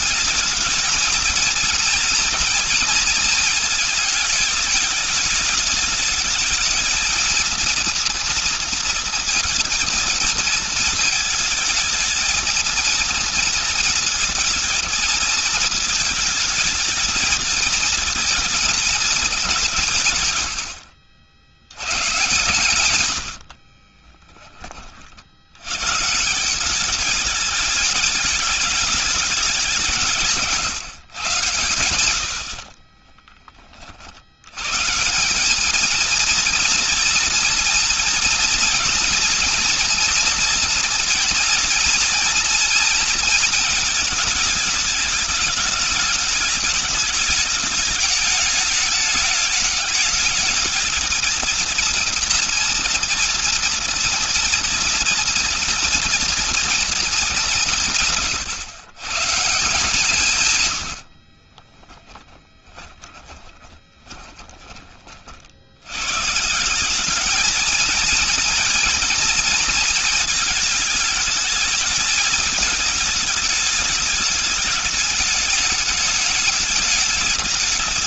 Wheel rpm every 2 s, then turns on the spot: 220, 230, 220, 220, 230, 220, 230, 220, 220, 220, 70, 120, 40, 200, 210, 140, 50, 140, 230, 230, 230, 230, 220, 210, 210, 220, 230, 230, 220, 130, 80, 10, 30, 190, 230, 210, 220, 210, 210.
22-24 32-34 60-64